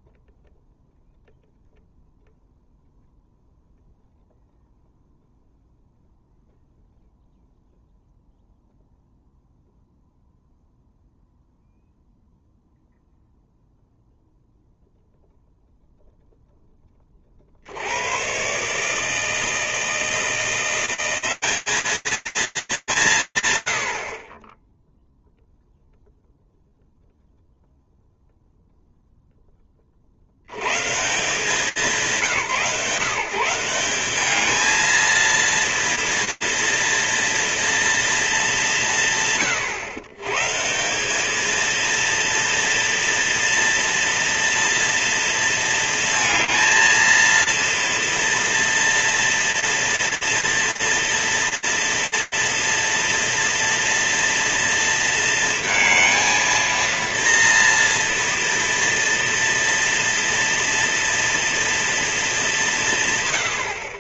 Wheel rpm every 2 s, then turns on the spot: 0, 0, 0, 0, 0, 0, 0, 0, 10, 140, 170, 220, 20, 0, 0, 180, 150, 230, 230, 140, 210, 230, 230, 220, 230, 230, 230, 230, 230, 230, 230, 110.
none